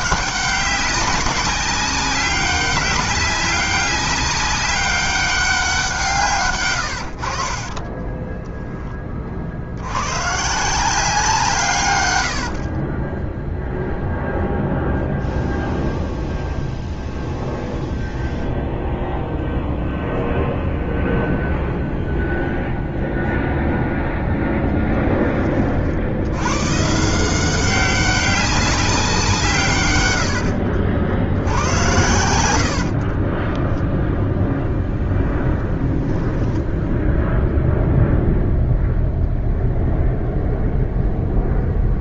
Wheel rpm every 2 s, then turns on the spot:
190, 200, 200, 90, 20, 170, 30, 0, 0, 0, 0, 0, 10, 140, 190, 70, 50, 0, 0, 0, 0.
6-8 12-14 32-34